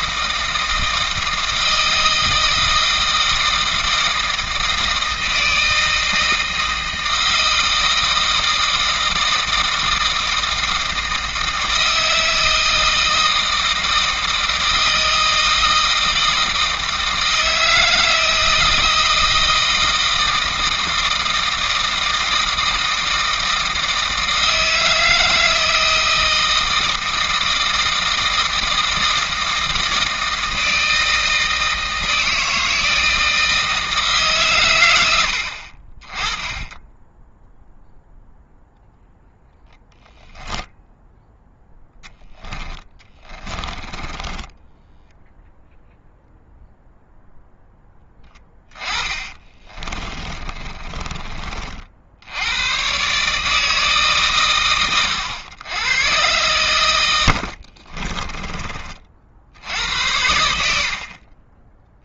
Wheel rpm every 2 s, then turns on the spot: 160, 160, 160, 160, 160, 160, 160, 160, 160, 160, 160, 160, 160, 160, 160, 160, 160, 100, 10, 0, 0, 20, 10, 0, 20, 30, 120, 110, 100, 30, 60.
36-38 42-46 48-52